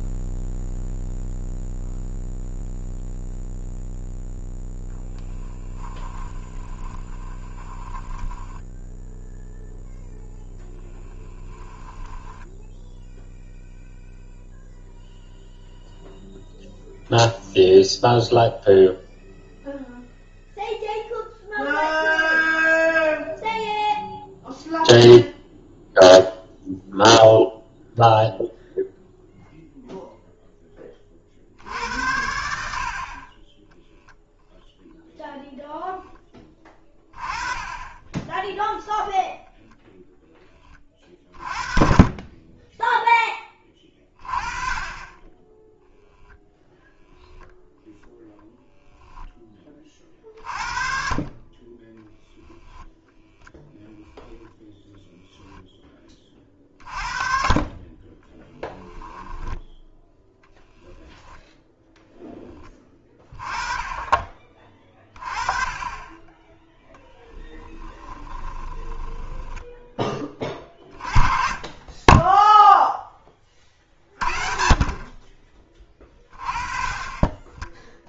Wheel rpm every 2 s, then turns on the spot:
0, 0, 0, 20, 10, 10, 0, 0, 0, 0, 0, 0, 0, 0, 0, 20, 60, 0, 20, 0, 30, 10, 20, 0, 0, 50, 10, 10, 50, 10, 0, 20, 30, 10, 10, 30, 0, 50, 30.
6-12 58-60 68-70